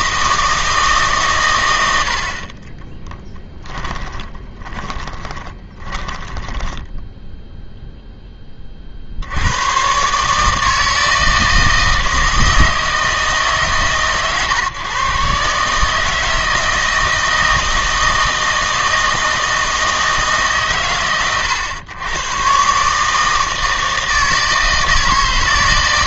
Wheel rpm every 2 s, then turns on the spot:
160, 30, 20, 10, 40, 160, 160, 130, 160, 160, 130, 140, 160.
2-8